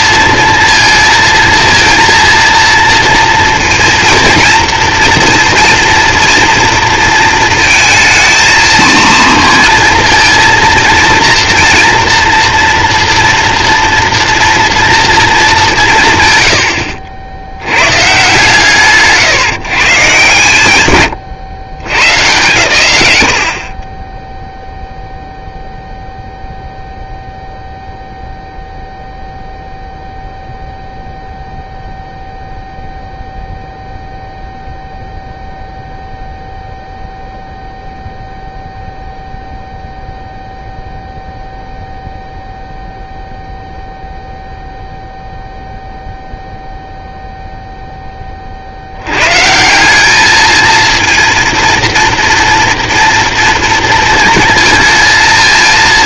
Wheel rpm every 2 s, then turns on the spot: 230, 230, 230, 230, 230, 230, 230, 240, 70, 140, 120, 120, 0, 0, 0, 0, 0, 0, 0, 0, 0, 0, 0, 0, 60, 220, 230, 230.
none